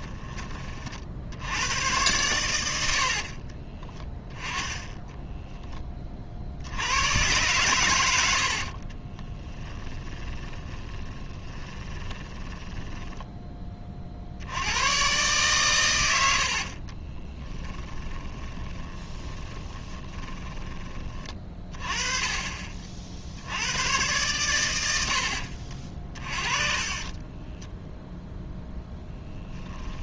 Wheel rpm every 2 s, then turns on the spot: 60, 90, 10, 80, 30, 10, 10, 110, 40, 10, 20, 50, 90, 30, 0.
8-14 16-20 26-28